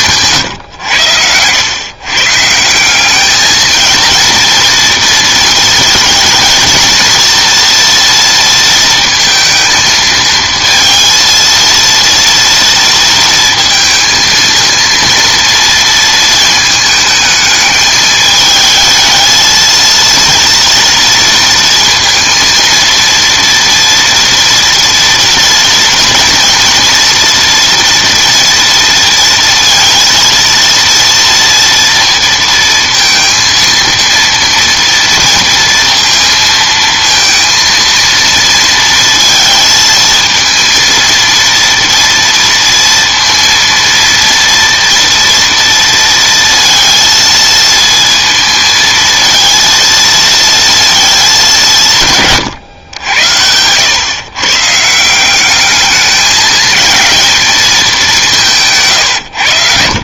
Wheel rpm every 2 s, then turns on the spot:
120, 160, 230, 220, 230, 230, 230, 230, 220, 220, 230, 230, 240, 240, 230, 230, 230, 230, 230, 230, 230, 230, 230, 230, 230, 220, 120, 140, 210, 170.
none